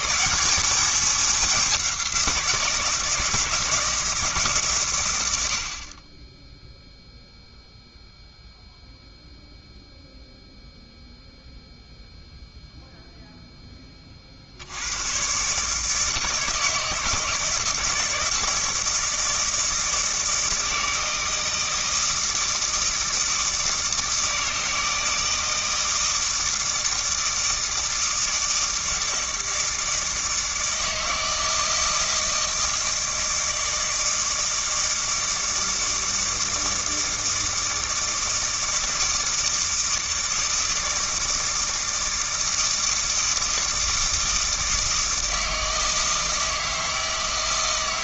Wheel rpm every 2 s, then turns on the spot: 210, 170, 120, 0, 0, 0, 0, 80, 160, 160, 160, 160, 160, 160, 160, 160, 160, 160, 160, 160, 160, 160, 160, 160.
none